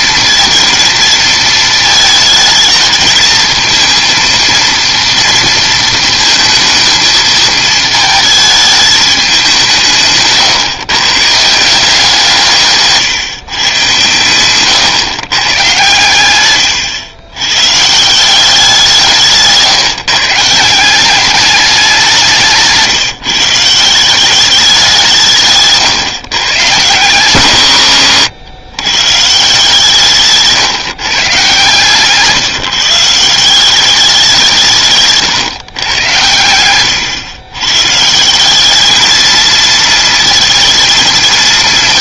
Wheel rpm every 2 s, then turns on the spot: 230, 220, 230, 220, 220, 140, 170, 110, 110, 180, 160, 160, 200, 120, 100, 150, 150, 170, 100, 190, 230.
14-18 22-24 36-38